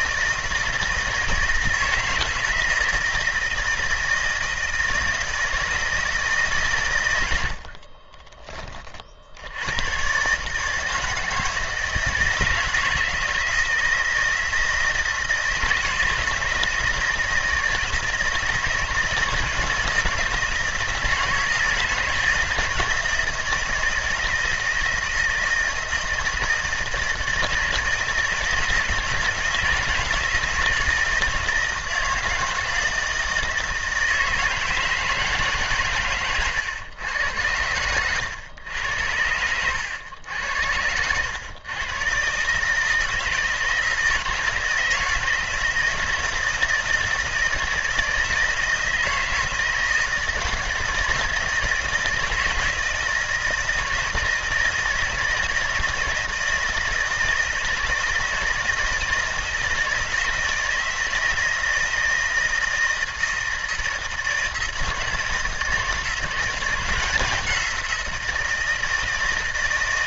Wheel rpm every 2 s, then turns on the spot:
160, 160, 160, 110, 40, 160, 160, 160, 160, 160, 170, 160, 160, 160, 160, 160, 160, 160, 110, 90, 90, 160, 160, 170, 160, 160, 160, 160, 160, 160, 160, 160, 160, 180, 160.
none